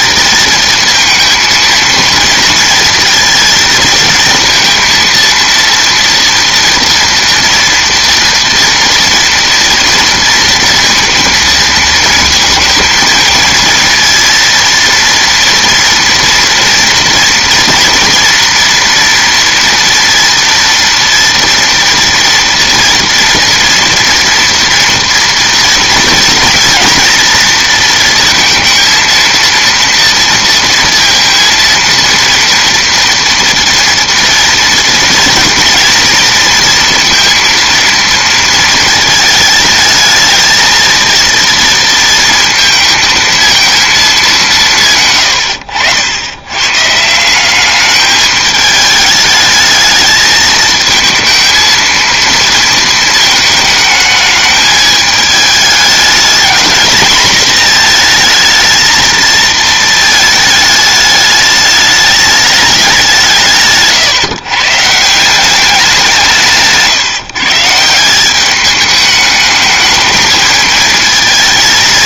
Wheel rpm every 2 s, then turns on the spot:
230, 230, 230, 230, 230, 230, 230, 230, 240, 230, 230, 230, 230, 230, 230, 230, 230, 230, 230, 220, 220, 220, 150, 120, 210, 220, 230, 220, 220, 230, 210, 200, 140, 160, 200, 220.
none